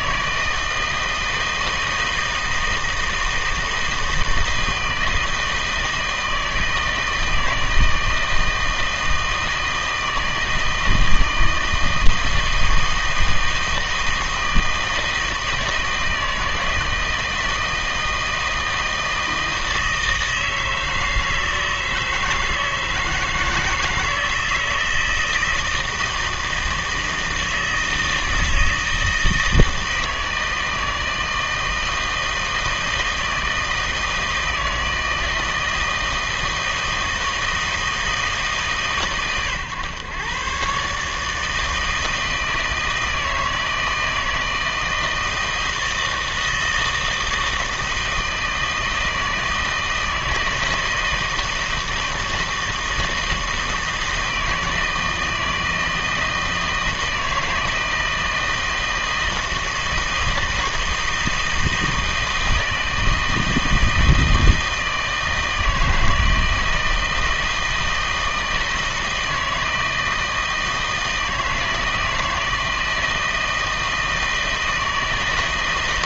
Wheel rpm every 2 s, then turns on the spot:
160, 160, 160, 160, 160, 160, 160, 160, 160, 160, 160, 160, 160, 160, 160, 160, 160, 160, 160, 140, 130, 160, 160, 160, 160, 160, 160, 160, 160, 160, 160, 160, 160, 160, 160, 160, 160, 160.
none